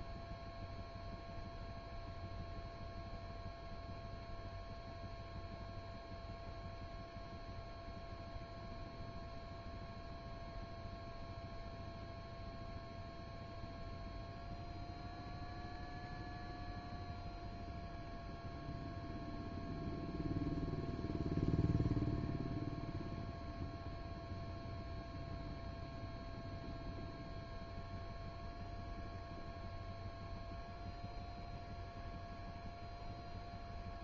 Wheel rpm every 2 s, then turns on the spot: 0, 0, 0, 0, 0, 0, 0, 0, 0, 0, 0, 0, 0, 0, 0, 0, 0.
none